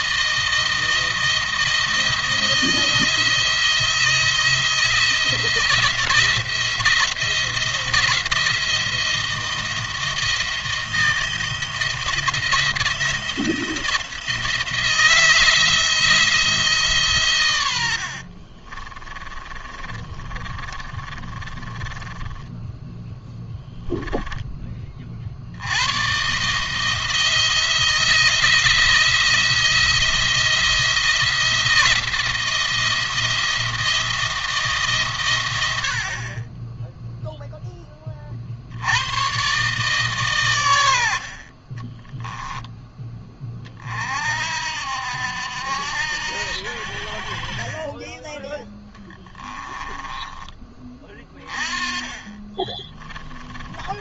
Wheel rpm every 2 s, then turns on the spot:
160, 160, 170, 170, 170, 160, 170, 160, 160, 40, 30, 10, 20, 150, 170, 170, 170, 160, 20, 60, 110, 10, 60, 70, 10, 20, 30.
18-24 48-50 52-54